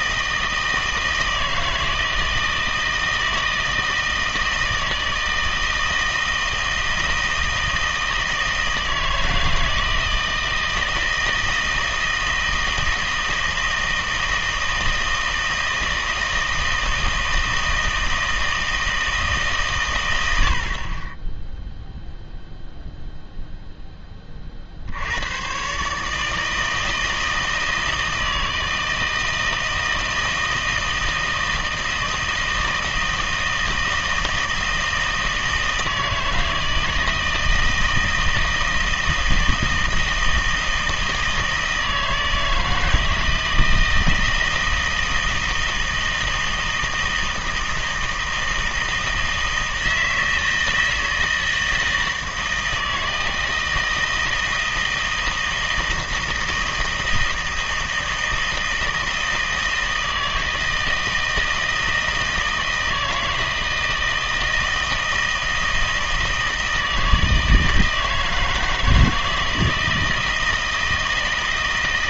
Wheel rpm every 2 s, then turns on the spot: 160, 160, 160, 160, 160, 160, 160, 160, 160, 160, 70, 0, 50, 160, 160, 160, 160, 160, 160, 160, 160, 160, 160, 160, 160, 160, 160, 160, 160, 160, 160, 160, 160, 160, 160, 160.
none